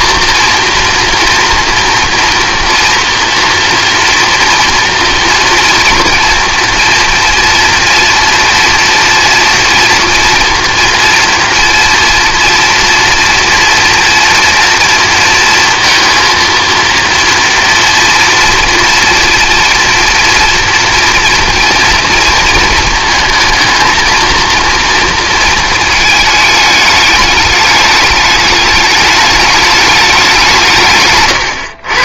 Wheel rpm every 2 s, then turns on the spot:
230, 230, 230, 230, 230, 230, 230, 230, 230, 240, 240, 230, 230, 210, 210, 160.
none